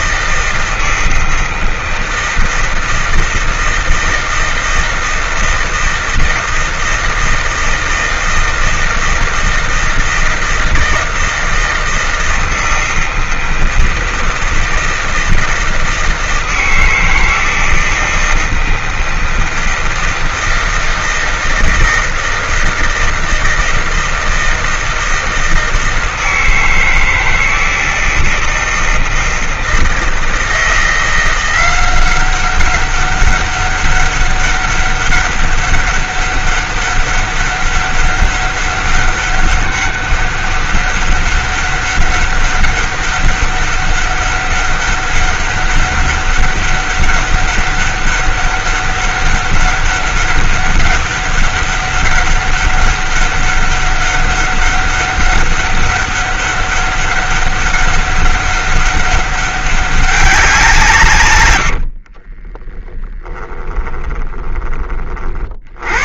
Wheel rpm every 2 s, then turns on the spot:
160, 160, 160, 160, 160, 160, 160, 160, 160, 170, 160, 160, 160, 160, 160, 160, 190, 200, 200, 200, 200, 200, 200, 200, 200, 190, 200, 200, 200, 200, 180, 20, 20.
62-64